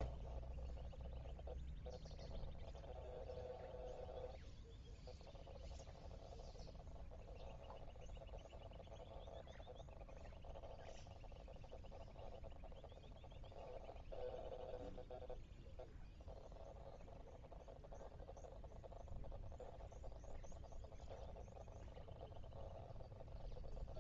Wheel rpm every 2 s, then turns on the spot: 0, 0, 0, 0, 0, 0, 0, 0, 0, 0, 0, 0.
none